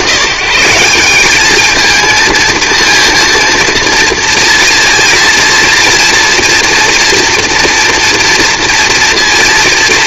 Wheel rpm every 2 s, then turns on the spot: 120, 230, 230, 230, 230.
none